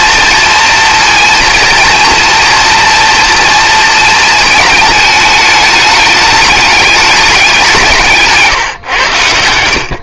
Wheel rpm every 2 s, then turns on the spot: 230, 230, 210, 200, 140.
none